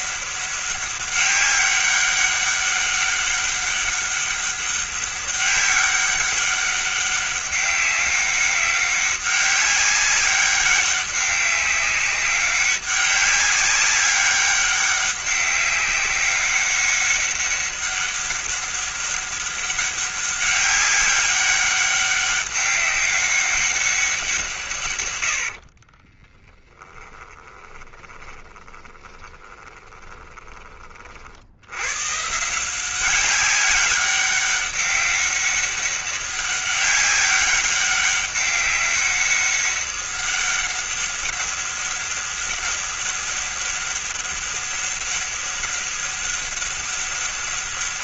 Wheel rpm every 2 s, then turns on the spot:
190, 200, 200, 200, 200, 200, 200, 200, 200, 200, 200, 200, 130, 10, 20, 30, 180, 200, 200, 200, 200, 200, 200, 200.
26-30